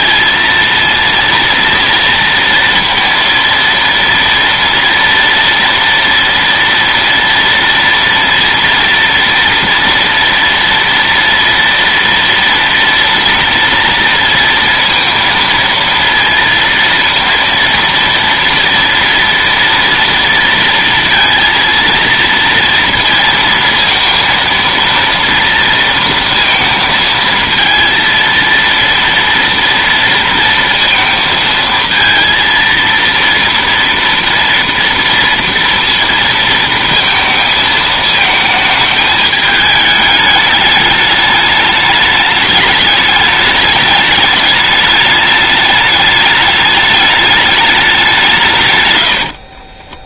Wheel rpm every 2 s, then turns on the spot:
230, 230, 230, 230, 230, 230, 230, 230, 230, 230, 230, 230, 230, 230, 230, 230, 230, 230, 230, 220, 210, 210, 210, 210, 140.
none